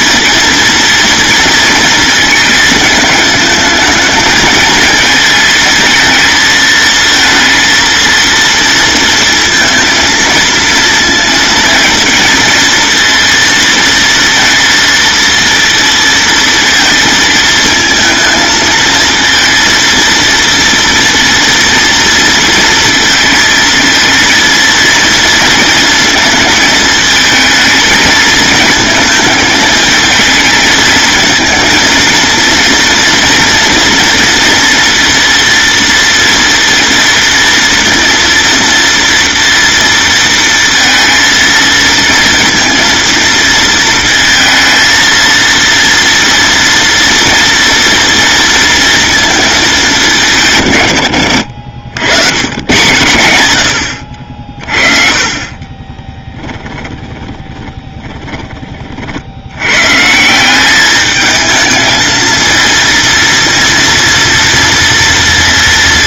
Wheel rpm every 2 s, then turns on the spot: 230, 220, 220, 230, 230, 230, 230, 230, 230, 220, 230, 230, 230, 220, 220, 220, 230, 230, 230, 240, 230, 230, 230, 230, 230, 120, 120, 40, 30, 50, 210, 230, 230.
56-58